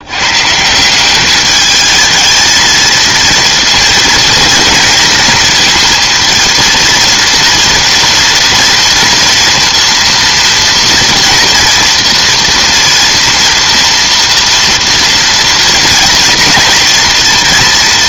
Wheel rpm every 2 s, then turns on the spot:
140, 220, 230, 230, 230, 230, 230, 230, 230.
none